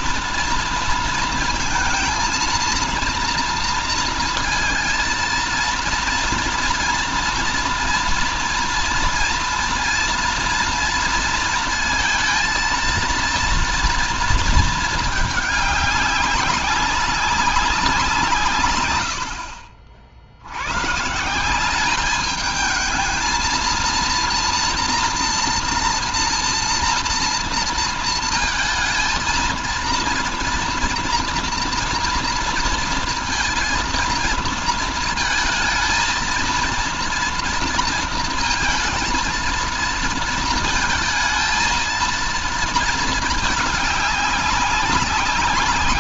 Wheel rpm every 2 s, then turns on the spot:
230, 230, 220, 230, 230, 230, 230, 220, 190, 120, 120, 220, 240, 230, 230, 240, 230, 230, 230, 230, 220, 220, 190.
none